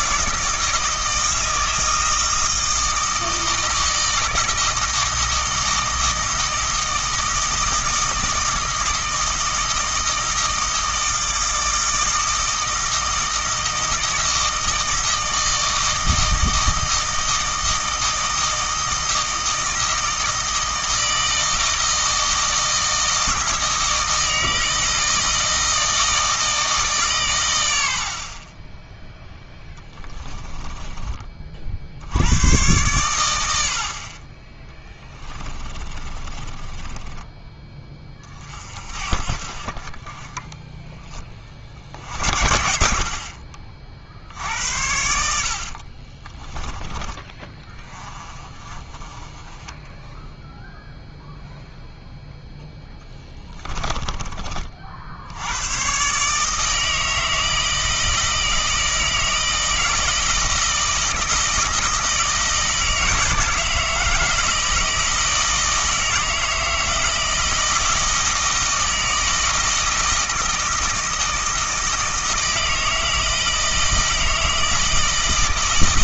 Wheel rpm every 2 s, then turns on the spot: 160, 160, 160, 160, 160, 160, 160, 160, 160, 160, 160, 160, 160, 140, 0, 20, 110, 10, 20, 50, 30, 60, 70, 20, 20, 0, 10, 60, 160, 160, 160, 160, 160, 160, 160, 160, 160, 160.
30-32 34-38 52-54